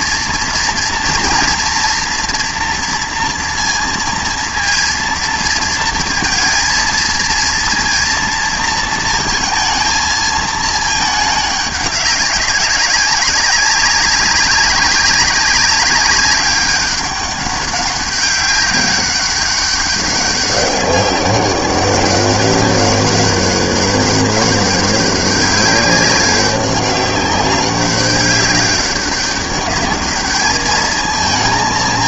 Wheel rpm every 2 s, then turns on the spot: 230, 230, 230, 230, 230, 220, 200, 200, 200, 200, 200, 200, 200, 190, 200, 210.
none